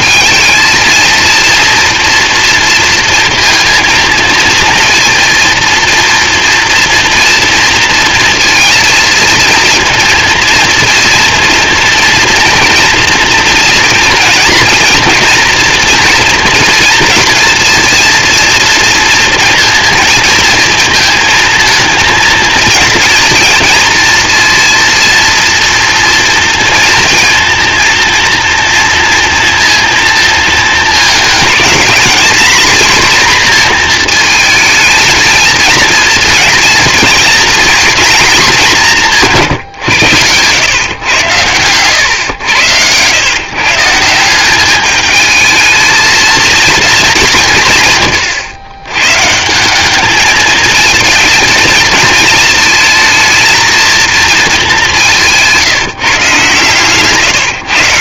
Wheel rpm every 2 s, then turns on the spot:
230, 230, 230, 230, 230, 230, 230, 230, 230, 230, 230, 230, 230, 230, 230, 220, 240, 230, 230, 210, 110, 100, 200, 230, 110, 220, 220, 200, 140.
none